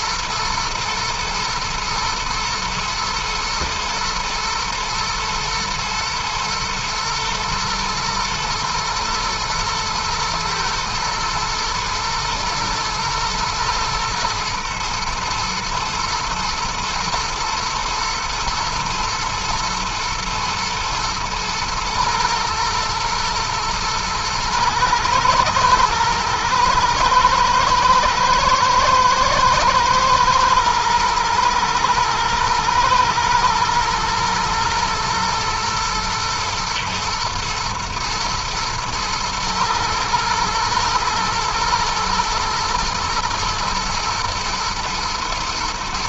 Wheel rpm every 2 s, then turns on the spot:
120, 110, 120, 110, 110, 120, 120, 110, 110, 120, 110, 110, 110, 110, 110, 120, 110, 110, 120, 110, 110, 110, 120.
none